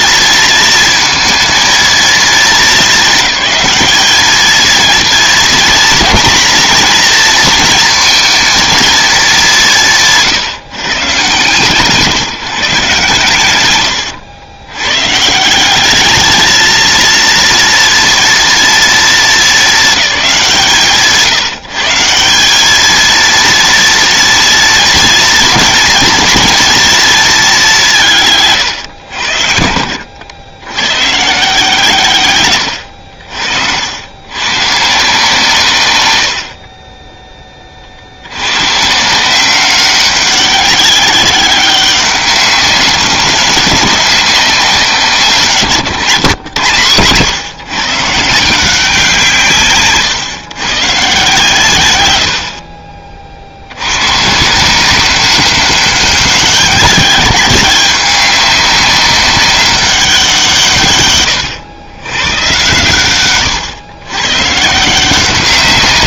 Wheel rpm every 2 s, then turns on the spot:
220, 210, 230, 230, 210, 140, 130, 130, 230, 220, 150, 220, 230, 220, 100, 130, 80, 150, 30, 130, 190, 190, 170, 120, 180, 140, 50, 180, 200, 190, 140, 120, 150.
32-34 36-38